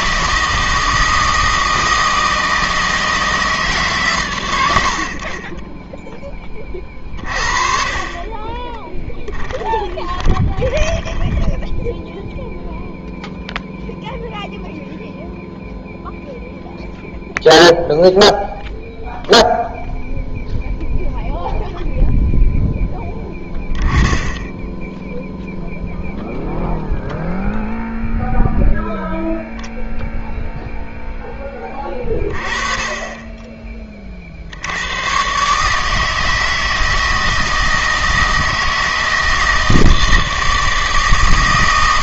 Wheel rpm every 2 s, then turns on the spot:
160, 160, 90, 40, 20, 10, 0, 0, 0, 0, 0, 10, 10, 0, 10, 0, 20, 90, 160, 160, 160.
8-12